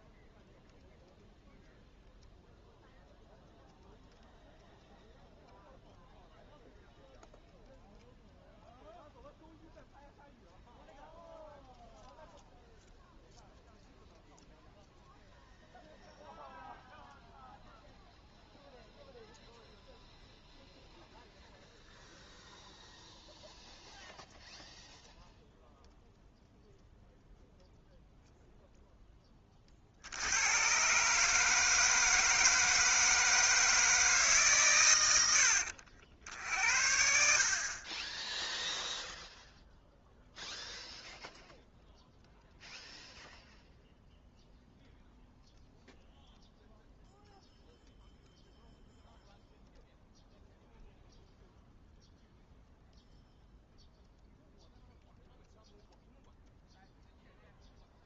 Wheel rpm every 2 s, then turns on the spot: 0, 0, 0, 0, 0, 0, 0, 0, 0, 0, 0, 0, 0, 0, 0, 110, 160, 140, 60, 0, 0, 0, 0, 0, 0, 0, 0, 0, 0.
none